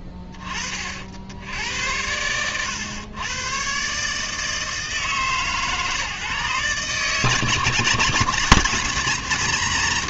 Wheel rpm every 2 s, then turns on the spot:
30, 100, 160, 140, 160.
none